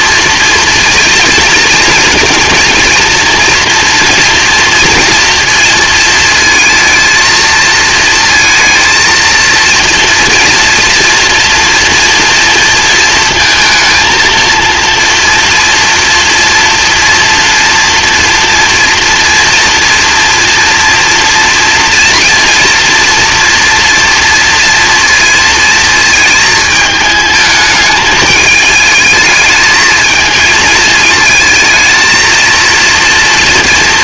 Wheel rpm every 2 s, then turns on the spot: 230, 230, 230, 230, 230, 230, 230, 230, 230, 230, 230, 230, 230, 220, 210, 220, 230.
none